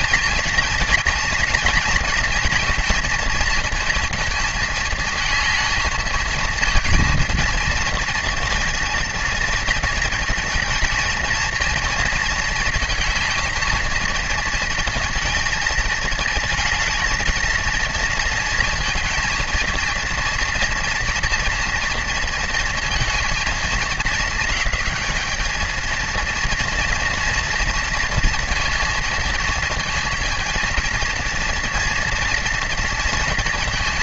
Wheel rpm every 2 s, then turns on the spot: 230, 230, 220, 230, 230, 230, 220, 230, 220, 230, 230, 230, 220, 230, 230, 230, 230.
none